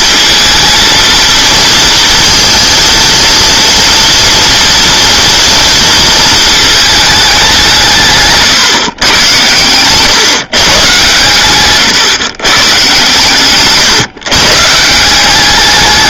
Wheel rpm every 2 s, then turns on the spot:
220, 230, 230, 220, 130, 130, 140, 150.
none